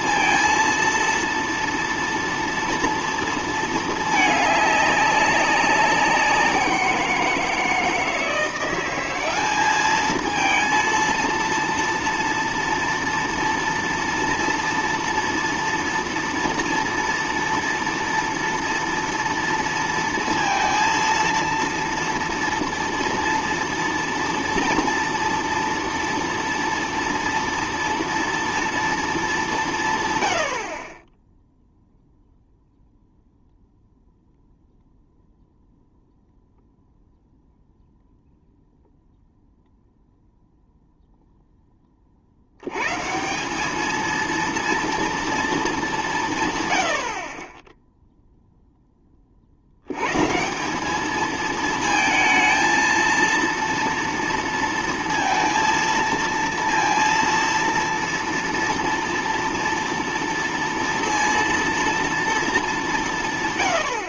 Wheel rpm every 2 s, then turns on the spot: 230, 240, 210, 180, 170, 230, 230, 230, 230, 230, 230, 230, 230, 230, 230, 80, 0, 0, 0, 0, 0, 90, 230, 120, 0, 170, 220, 230, 230, 230, 230, 210.
none